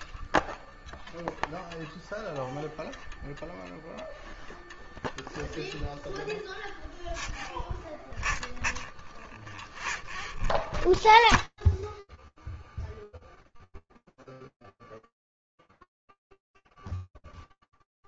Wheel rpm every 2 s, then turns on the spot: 0, 0, 0, 0, 0, 0, 0, 0, 0.
none